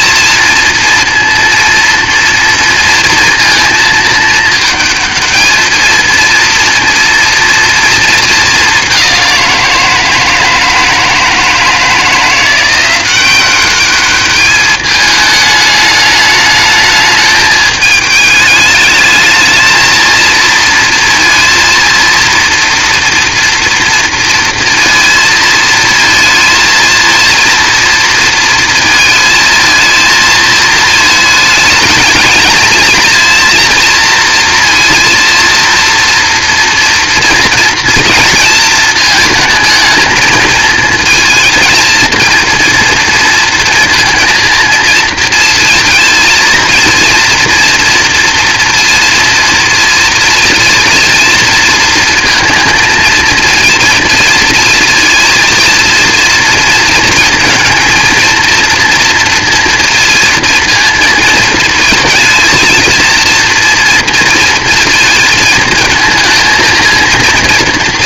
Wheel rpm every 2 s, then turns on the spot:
230, 230, 220, 230, 210, 160, 170, 210, 210, 210, 230, 230, 230, 230, 230, 220, 220, 230, 240, 230, 230, 230, 230, 230, 230, 230, 220, 230, 230, 230, 230, 220, 230, 220.
none